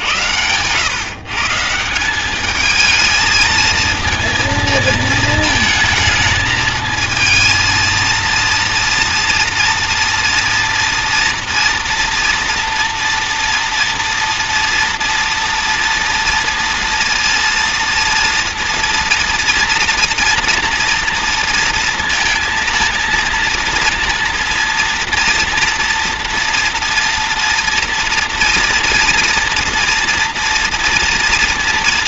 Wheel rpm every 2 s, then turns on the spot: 110, 210, 220, 220, 230, 230, 230, 230, 240, 230, 230, 230, 230, 230, 230, 230.
0-2